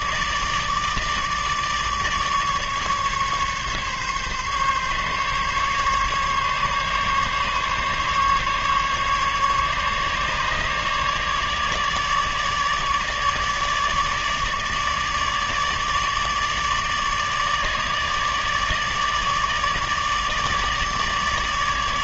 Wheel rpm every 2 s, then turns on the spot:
150, 150, 140, 140, 150, 150, 150, 150, 150, 150, 150.
none